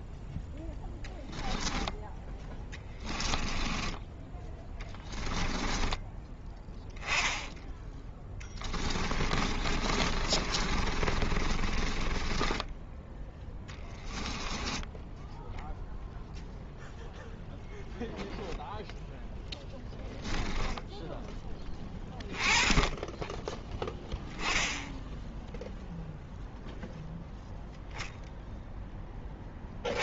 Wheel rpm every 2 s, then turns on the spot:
0, 10, 10, 10, 10, 30, 10, 10, 0, 0, 10, 20, 10, 0, 0.
2-4 8-14